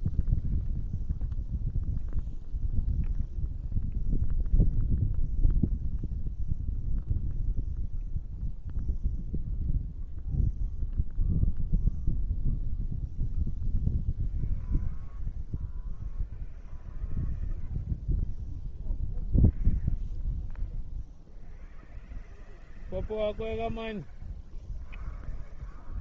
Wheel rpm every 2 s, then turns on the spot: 0, 0, 0, 0, 0, 0, 0, 0, 0, 0, 0, 0, 0.
none